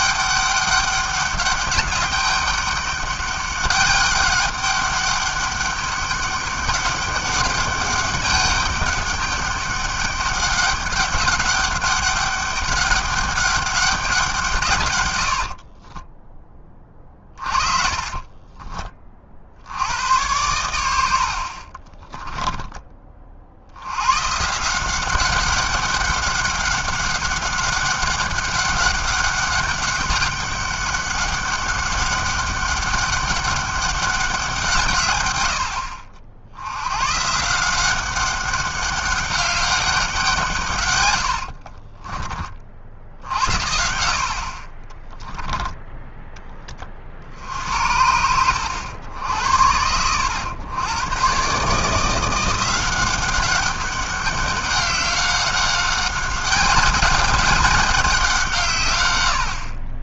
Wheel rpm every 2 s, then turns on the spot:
200, 200, 200, 200, 200, 200, 200, 200, 30, 30, 80, 30, 100, 190, 200, 200, 200, 200, 80, 180, 190, 40, 70, 10, 70, 90, 160, 190, 190, 180.
16-20 22-24 42-44 46-48